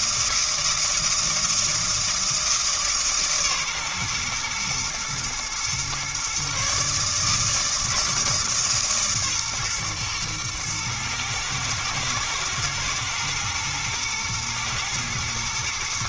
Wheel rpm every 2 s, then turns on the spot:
160, 150, 120, 140, 150, 110, 110, 120.
none